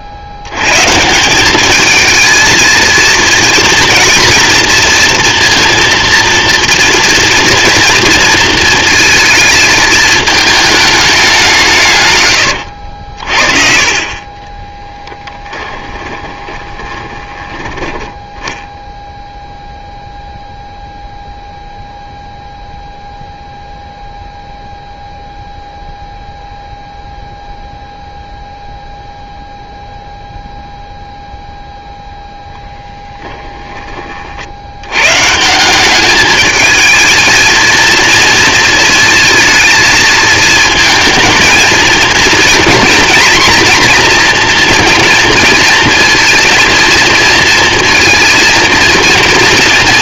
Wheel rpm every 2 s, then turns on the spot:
80, 230, 230, 230, 230, 220, 90, 20, 20, 0, 0, 0, 0, 0, 0, 0, 10, 80, 220, 230, 220, 230, 230, 230, 230.
12-18 32-34